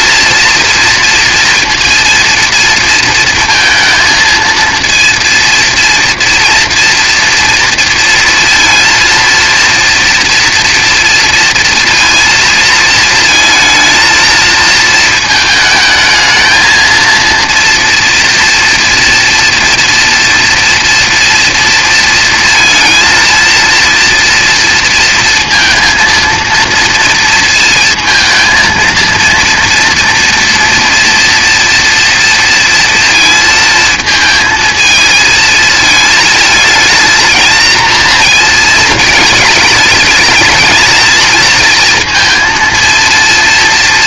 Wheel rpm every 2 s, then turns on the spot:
230, 230, 230, 240, 230, 230, 220, 220, 220, 230, 230, 230, 230, 230, 230, 230, 230, 220, 220, 230, 220, 230.
none